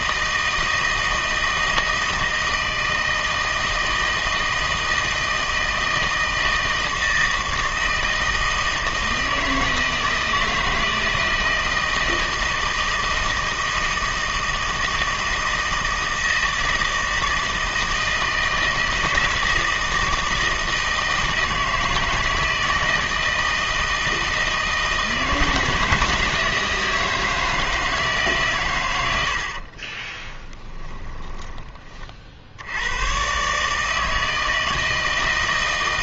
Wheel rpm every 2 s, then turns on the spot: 160, 160, 160, 160, 160, 160, 160, 160, 160, 160, 160, 160, 160, 160, 120, 20, 70, 160.
30-32